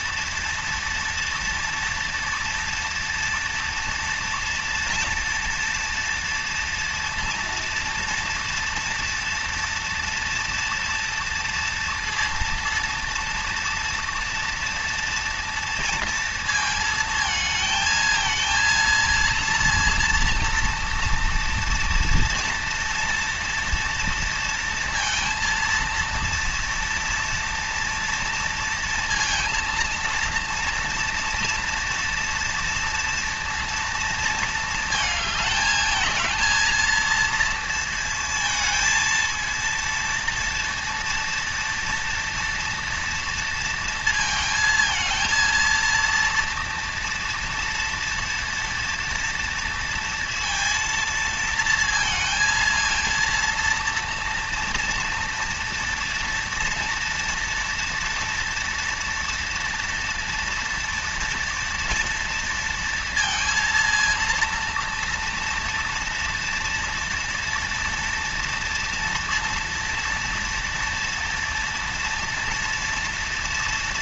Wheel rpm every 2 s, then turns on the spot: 230, 230, 230, 230, 230, 230, 230, 230, 220, 220, 230, 230, 230, 230, 230, 230, 230, 220, 220, 220, 230, 230, 220, 230, 230, 230, 230, 230, 230, 240, 230, 230, 230, 240, 230, 230, 230.
none